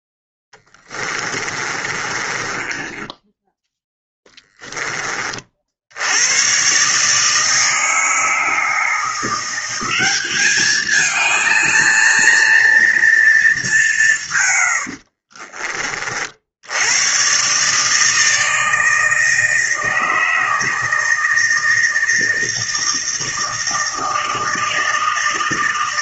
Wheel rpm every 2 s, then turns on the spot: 10, 20, 20, 130, 160, 210, 230, 110, 80, 160, 160, 160, 160.
0-4 14-16